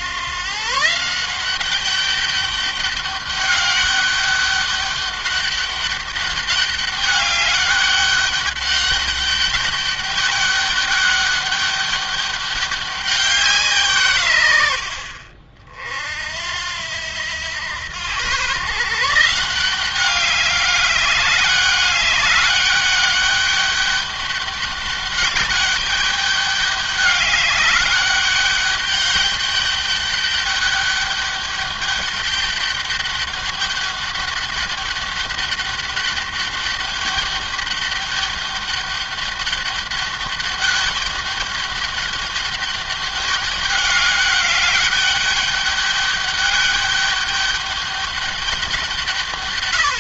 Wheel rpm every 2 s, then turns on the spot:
140, 200, 200, 200, 200, 200, 200, 80, 80, 140, 200, 200, 200, 200, 200, 200, 200, 200, 200, 200, 200, 200, 200, 200, 180.
none